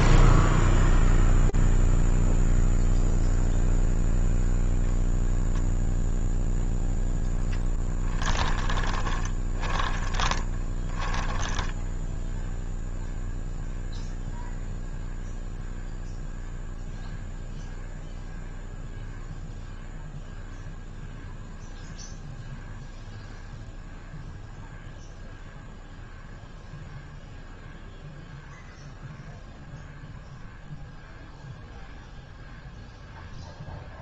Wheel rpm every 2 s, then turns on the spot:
0, 0, 0, 0, 10, 20, 10, 0, 0, 0, 0, 0, 0, 0, 0, 0, 0.
10-14